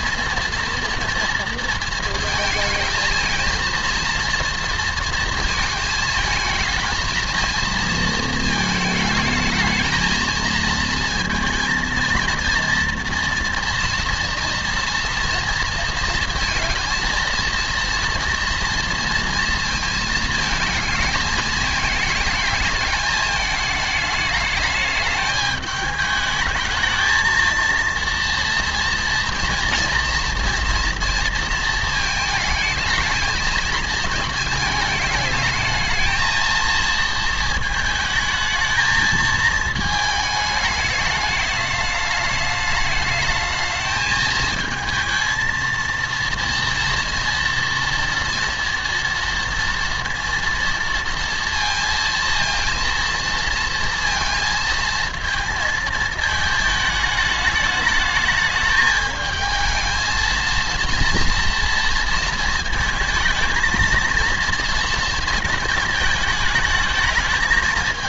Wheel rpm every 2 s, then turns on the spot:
230, 220, 230, 220, 220, 220, 230, 240, 230, 230, 220, 210, 210, 220, 230, 240, 220, 220, 230, 220, 220, 210, 220, 230, 230, 230, 230, 230, 220, 210, 230, 230, 230, 220.
none